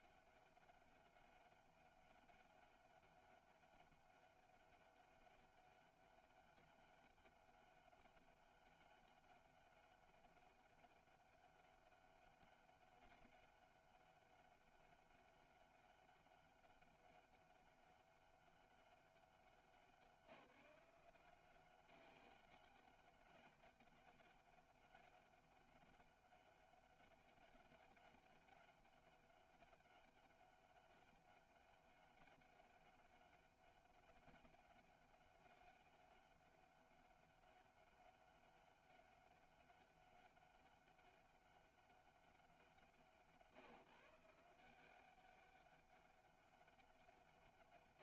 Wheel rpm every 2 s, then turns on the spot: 200, 190, 200, 200, 200, 200, 200, 200, 200, 200, 170, 200, 200, 200, 200, 200, 200, 200, 200, 200, 200, 170, 180, 200.
none